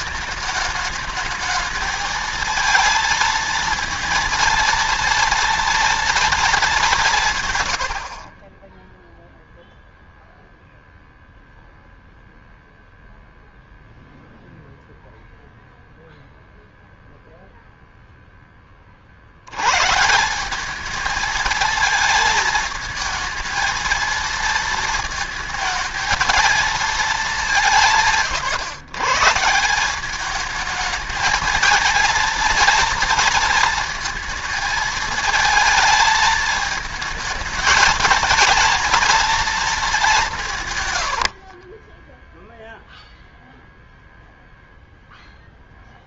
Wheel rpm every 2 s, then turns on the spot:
210, 230, 230, 210, 20, 0, 0, 0, 0, 30, 200, 220, 230, 230, 130, 220, 230, 230, 220, 230, 140, 0, 0.
40-42